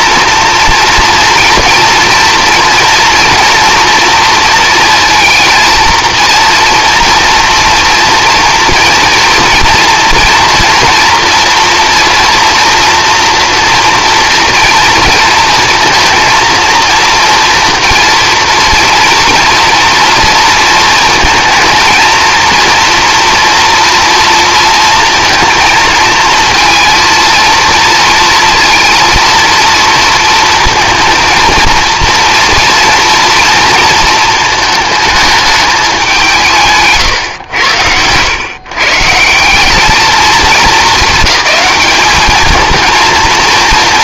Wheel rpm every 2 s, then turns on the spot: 230, 240, 230, 230, 230, 230, 230, 230, 230, 230, 230, 230, 230, 230, 230, 230, 230, 220, 150, 130, 220, 220.
none